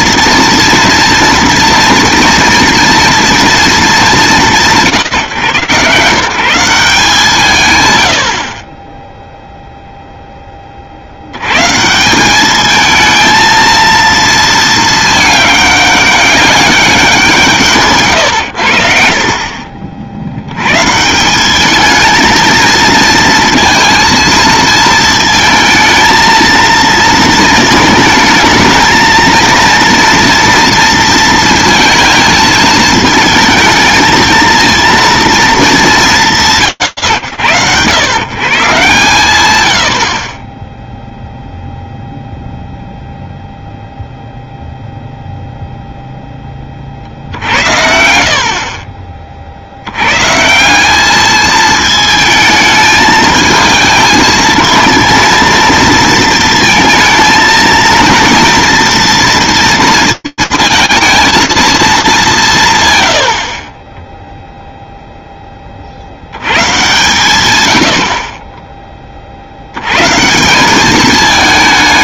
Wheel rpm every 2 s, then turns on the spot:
230, 230, 160, 180, 20, 30, 210, 220, 200, 90, 120, 230, 220, 230, 220, 230, 220, 230, 110, 130, 0, 0, 0, 20, 50, 160, 220, 220, 220, 230, 230, 90, 0, 140, 20, 210.
none